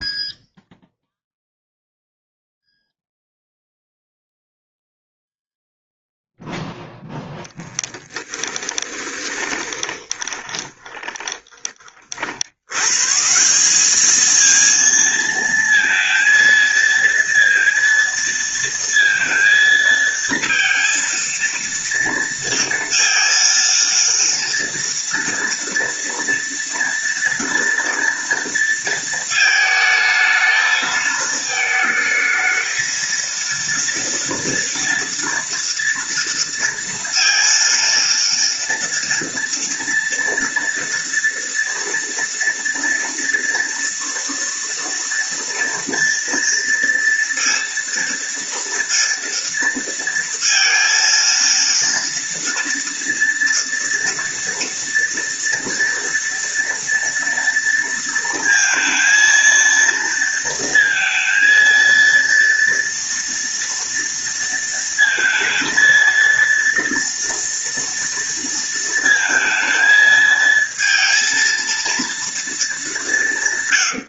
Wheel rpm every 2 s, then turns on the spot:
0, 0, 0, 0, 20, 30, 170, 230, 230, 230, 230, 230, 230, 230, 220, 220, 230, 230, 230, 230, 230, 240, 230, 230, 230, 230, 240, 230, 230, 230, 230, 230, 220, 230, 220, 230, 160.
8-10